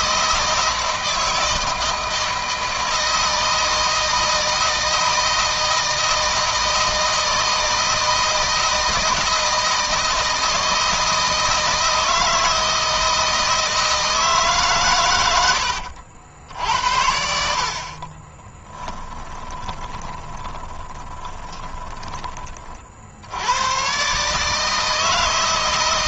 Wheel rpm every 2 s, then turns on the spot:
160, 160, 160, 160, 160, 160, 160, 120, 80, 20, 20, 60, 160.
14-16 18-22